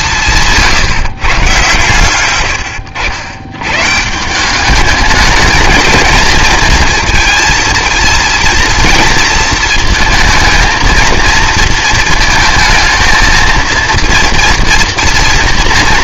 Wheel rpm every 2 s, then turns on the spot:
150, 110, 200, 230, 230, 230, 220, 230.
0-2